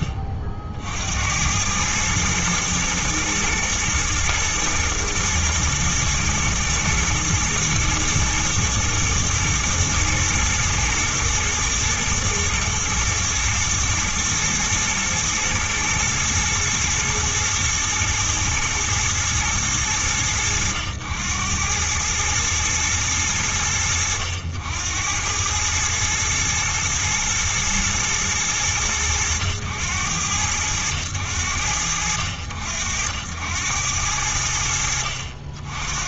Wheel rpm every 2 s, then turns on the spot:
50, 110, 120, 120, 120, 120, 120, 120, 120, 110, 90, 100, 90, 110, 100, 100, 70, 60.
none